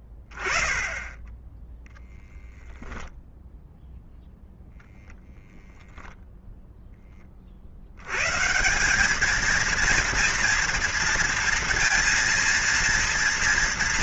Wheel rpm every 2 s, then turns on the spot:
20, 0, 0, 10, 180, 230, 230.
none